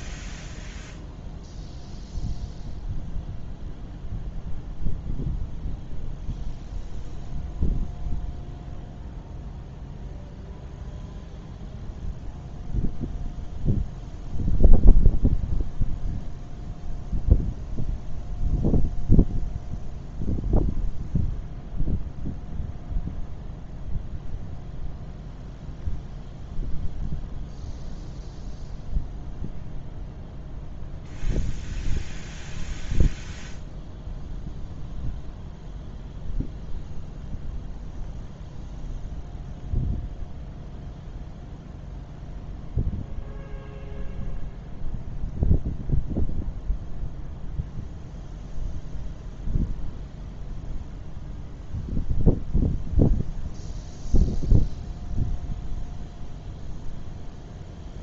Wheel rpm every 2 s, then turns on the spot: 0, 0, 0, 0, 0, 0, 0, 0, 0, 0, 0, 0, 0, 0, 0, 0, 0, 0, 0, 0, 0, 0, 0, 0, 0, 0, 0, 0, 0.
none